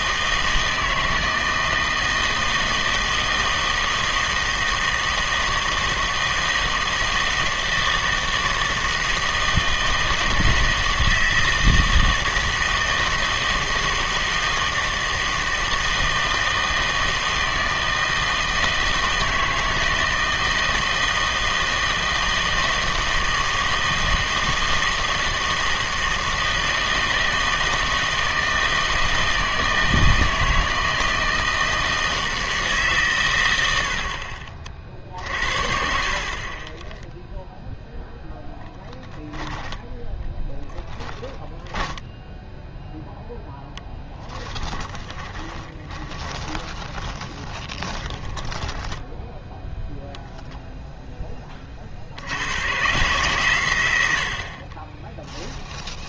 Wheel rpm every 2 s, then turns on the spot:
160, 160, 160, 160, 160, 160, 160, 160, 160, 160, 160, 160, 160, 160, 160, 160, 150, 50, 30, 0, 10, 0, 10, 20, 20, 0, 120, 40.
44-50